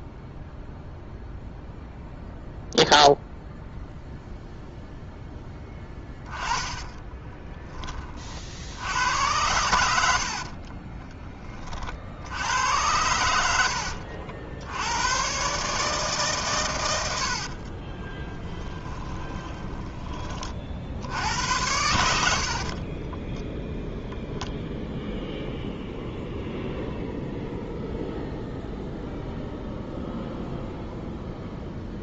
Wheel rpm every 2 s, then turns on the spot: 0, 0, 0, 20, 70, 30, 100, 90, 120, 20, 60, 50, 0, 0, 0, 0.
6-8 10-12 18-20 22-24